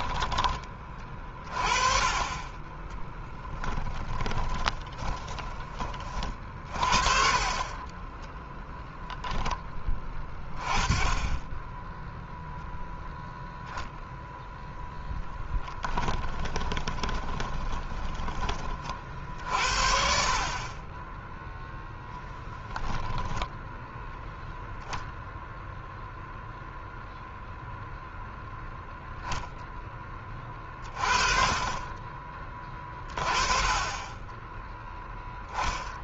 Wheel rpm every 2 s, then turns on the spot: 30, 10, 10, 40, 0, 10, 0, 0, 20, 40, 30, 0, 0, 0, 0, 30, 20, 0.
2-8 16-18